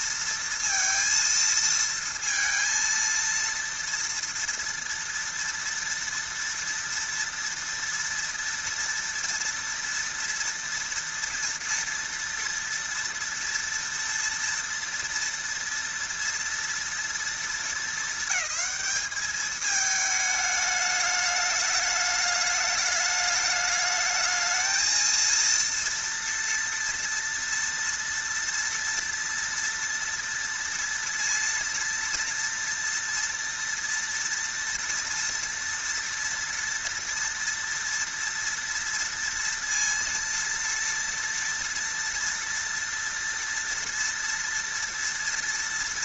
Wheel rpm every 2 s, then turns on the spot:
230, 230, 230, 230, 230, 230, 230, 230, 230, 210, 210, 210, 220, 230, 230, 230, 240, 230, 230, 230, 230, 230, 230.
none